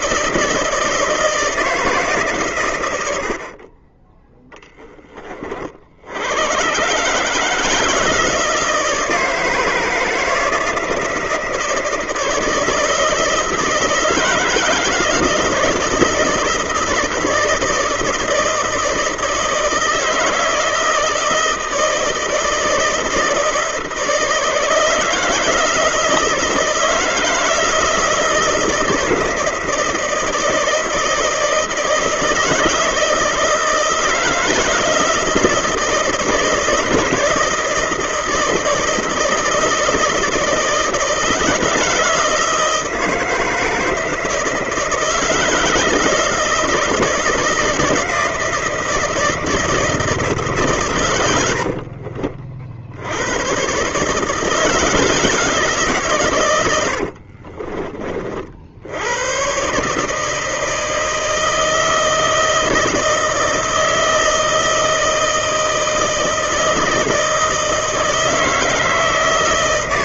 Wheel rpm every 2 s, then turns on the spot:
170, 110, 20, 130, 160, 160, 160, 160, 170, 160, 160, 160, 160, 160, 160, 160, 160, 160, 160, 170, 160, 160, 160, 160, 160, 130, 70, 160, 80, 90, 160, 160, 160, 160, 160.
56-58